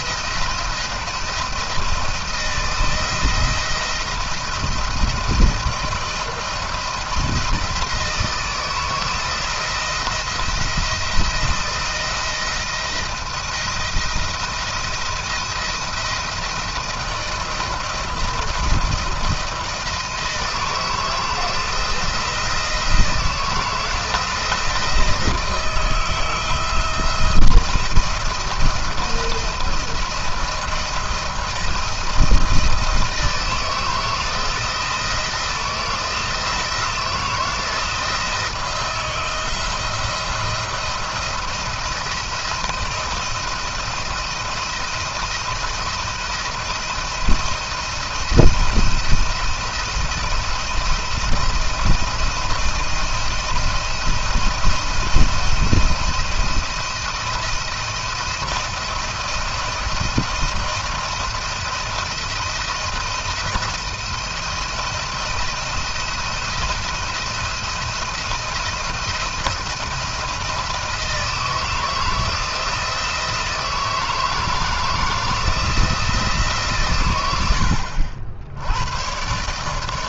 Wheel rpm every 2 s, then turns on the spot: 170, 160, 170, 170, 160, 170, 170, 170, 160, 170, 160, 170, 170, 160, 170, 170, 160, 170, 170, 160, 170, 170, 170, 170, 170, 170, 170, 170, 170, 170, 170, 160, 170, 170, 170, 170, 160, 160, 150, 90.
none